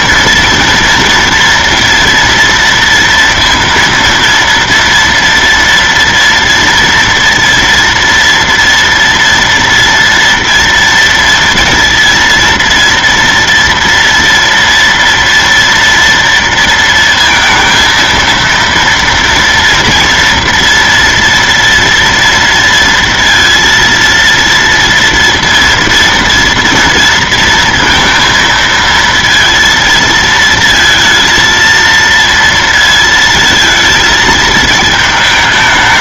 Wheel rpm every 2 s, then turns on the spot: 230, 230, 230, 230, 230, 230, 230, 230, 230, 230, 240, 230, 230, 230, 230, 230, 230, 220.
none